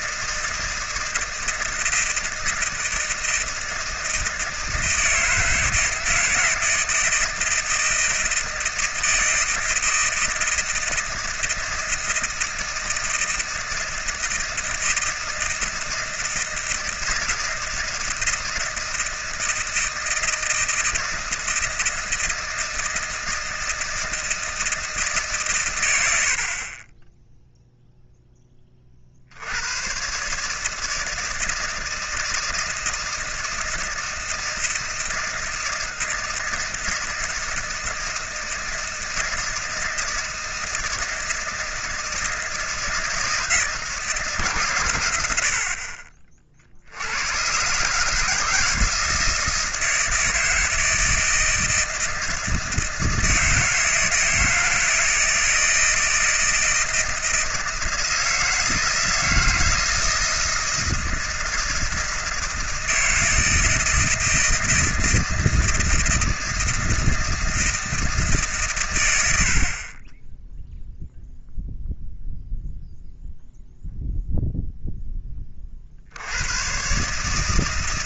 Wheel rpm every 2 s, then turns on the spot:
160, 160, 160, 160, 160, 160, 160, 160, 160, 160, 160, 160, 160, 30, 30, 150, 160, 160, 160, 160, 160, 160, 120, 80, 160, 160, 160, 160, 160, 160, 160, 160, 160, 160, 130, 0, 0, 0, 120.
none